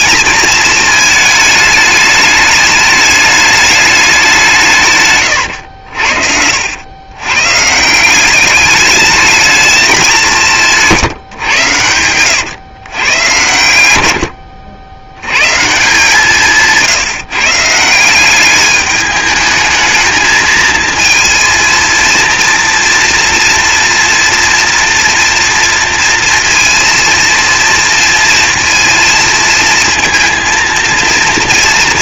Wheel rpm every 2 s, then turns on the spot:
220, 210, 150, 90, 200, 170, 130, 70, 160, 200, 220, 230, 230, 230, 230, 230.
none